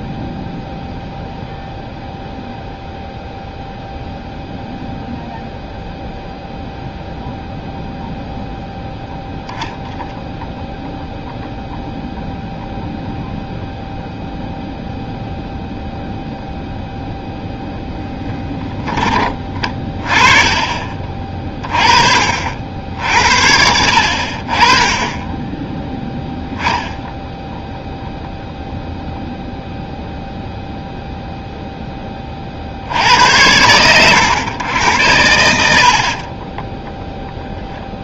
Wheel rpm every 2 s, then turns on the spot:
0, 0, 0, 0, 0, 0, 0, 0, 0, 10, 30, 60, 40, 0, 0, 0, 50, 90, 10.
none